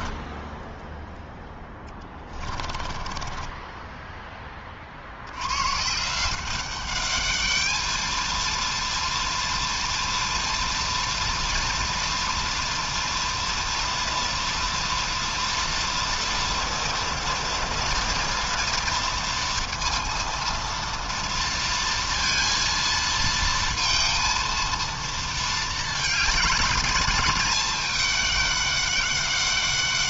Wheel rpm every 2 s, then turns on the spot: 0, 20, 20, 180, 230, 230, 230, 230, 230, 230, 230, 230, 230, 220, 210.
2-4